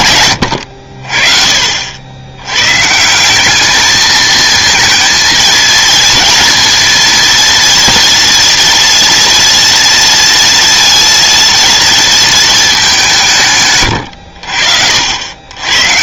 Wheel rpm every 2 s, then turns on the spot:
110, 110, 220, 230, 230, 230, 220, 70.
none